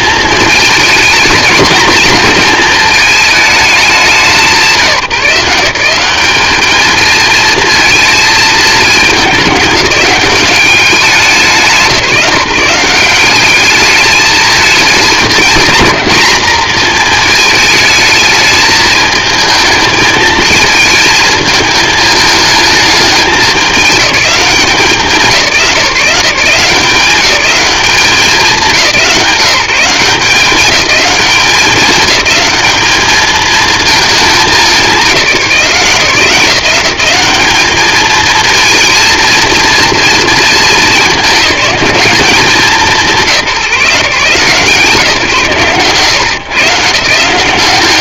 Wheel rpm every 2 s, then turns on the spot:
230, 230, 180, 220, 220, 190, 180, 220, 230, 220, 220, 210, 190, 180, 180, 200, 210, 200, 180, 230, 210, 190, 150, 130.
none